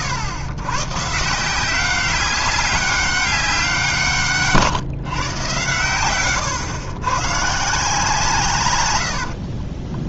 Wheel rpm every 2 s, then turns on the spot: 120, 190, 150, 110, 120.
8-10